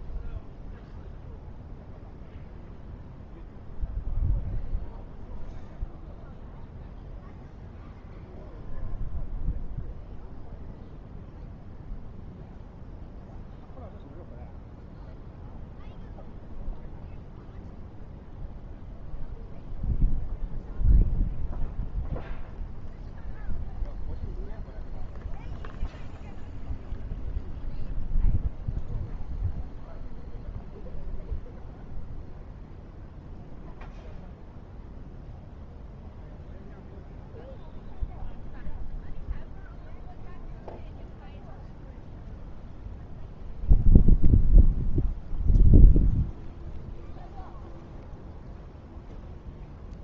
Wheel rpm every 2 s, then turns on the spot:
0, 0, 0, 0, 0, 0, 0, 0, 0, 0, 0, 0, 0, 0, 0, 0, 0, 0, 0, 0, 0, 0, 0, 0, 0.
none